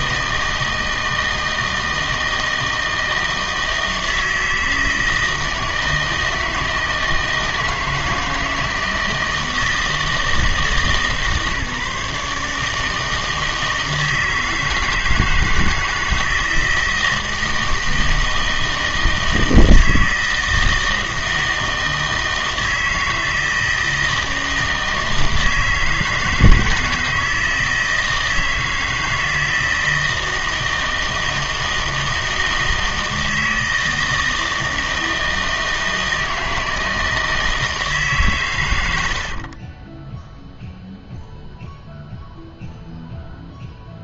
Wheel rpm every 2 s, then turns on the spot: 160, 160, 160, 160, 160, 160, 150, 160, 160, 160, 160, 160, 160, 160, 160, 160, 160, 160, 160, 100, 0, 0.
none